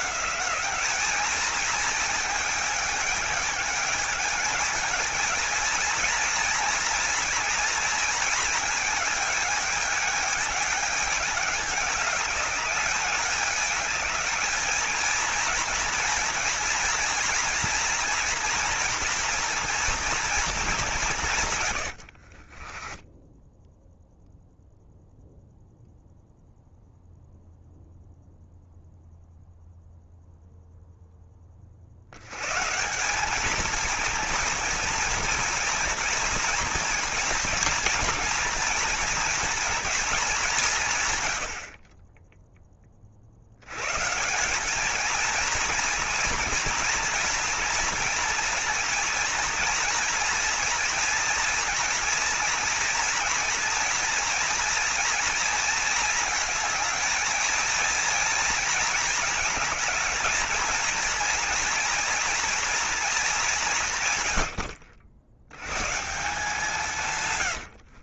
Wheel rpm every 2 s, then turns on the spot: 210, 210, 210, 230, 220, 210, 210, 220, 230, 230, 200, 20, 0, 0, 0, 0, 160, 230, 240, 230, 130, 30, 220, 230, 230, 230, 230, 240, 220, 230, 230, 220, 50, 160.
22-24